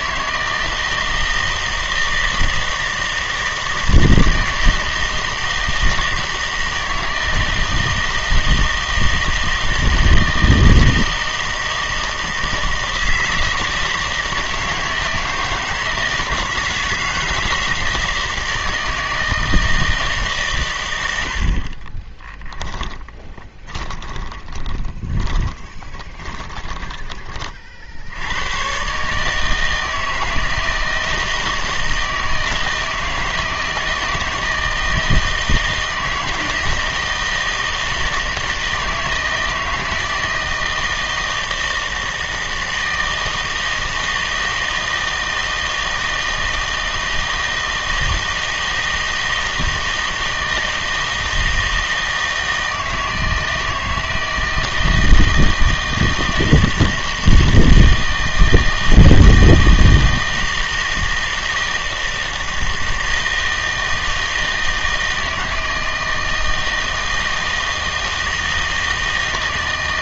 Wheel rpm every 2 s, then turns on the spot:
160, 160, 160, 160, 160, 160, 160, 160, 160, 160, 130, 10, 20, 20, 120, 160, 160, 160, 160, 160, 160, 160, 160, 160, 160, 160, 160, 160, 160, 160, 160, 160, 160, 160, 160.
22-28